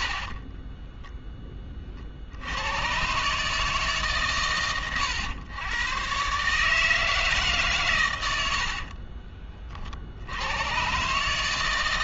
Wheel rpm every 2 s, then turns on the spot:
20, 110, 110, 150, 60, 100.
0-2 8-10